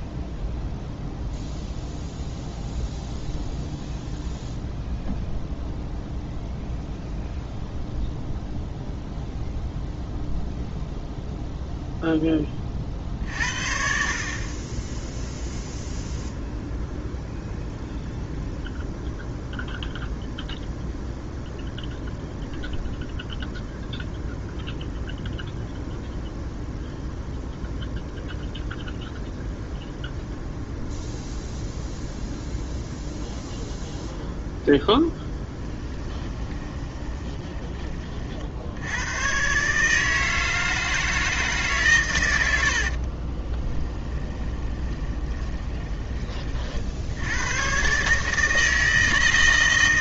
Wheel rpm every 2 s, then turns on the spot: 0, 0, 0, 0, 0, 0, 40, 20, 0, 0, 0, 0, 0, 0, 0, 0, 0, 0, 20, 90, 160, 70, 20, 60, 160.
36-38 42-46